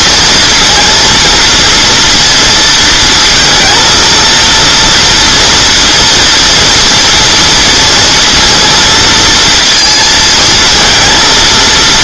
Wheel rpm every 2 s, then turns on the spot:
230, 230, 230, 240, 230, 220.
none